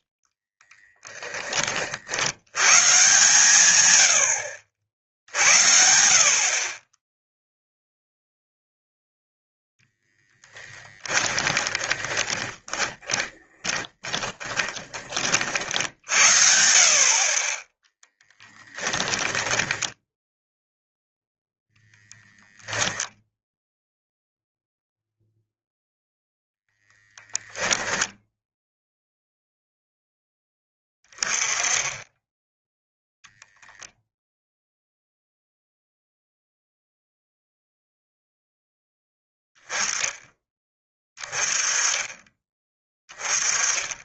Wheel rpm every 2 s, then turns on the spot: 20, 130, 70, 30, 0, 10, 20, 20, 50, 10, 0, 0, 0, 0, 0, 20, 0, 0, 0, 10, 20, 20.
0-2 10-16 18-20